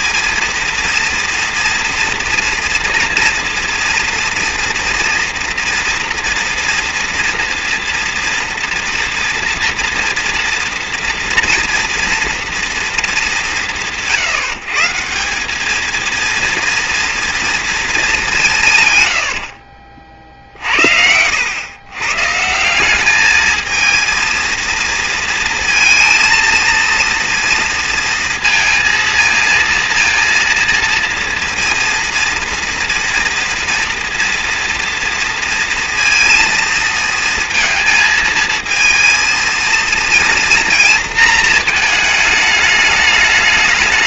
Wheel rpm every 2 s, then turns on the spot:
230, 230, 230, 240, 230, 230, 230, 150, 230, 150, 60, 170, 230, 230, 220, 230, 230, 230, 230, 220, 220, 210.
18-20